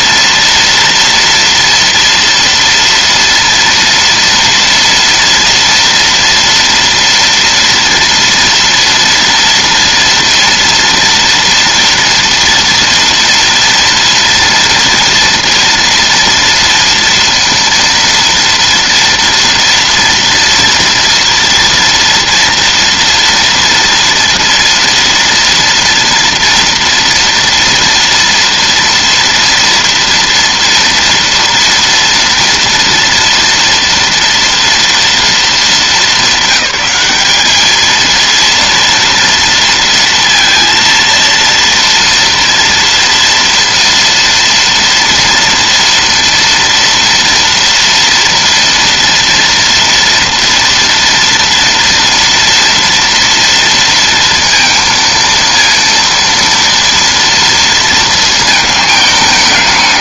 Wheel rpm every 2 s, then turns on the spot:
230, 230, 230, 230, 230, 230, 230, 230, 230, 230, 230, 230, 230, 230, 230, 230, 230, 230, 200, 230, 230, 230, 230, 230, 230, 230, 230, 230, 230, 220.
none